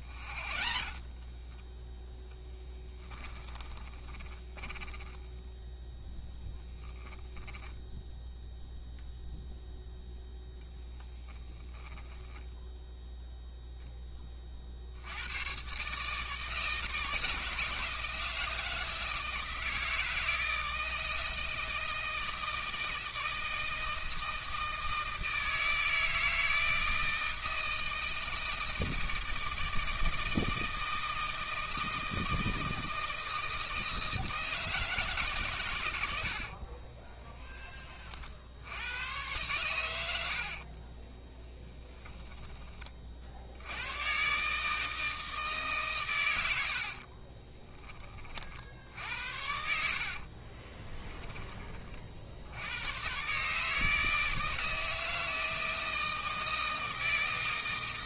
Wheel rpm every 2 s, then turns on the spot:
40, 10, 10, 10, 0, 10, 0, 50, 160, 160, 160, 160, 160, 160, 160, 160, 160, 160, 40, 80, 50, 30, 150, 80, 60, 30, 90, 160, 160.
0-8 36-38 40-42 46-48 50-52